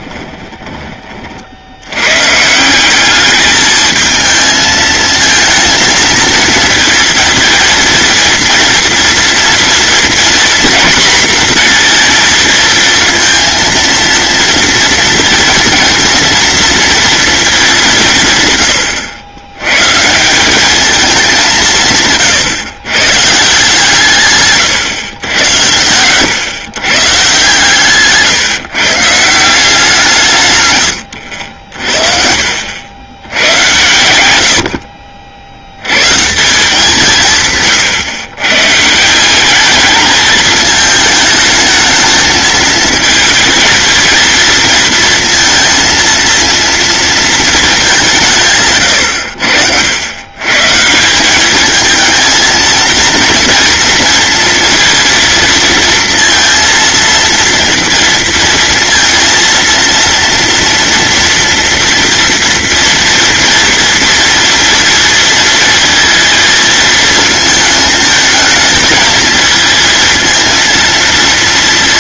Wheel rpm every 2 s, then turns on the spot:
30, 190, 220, 230, 240, 240, 230, 230, 230, 90, 210, 120, 140, 130, 150, 100, 100, 60, 170, 150, 220, 230, 230, 230, 120, 150, 230, 230, 230, 230, 230, 230, 230, 220, 220, 230.
none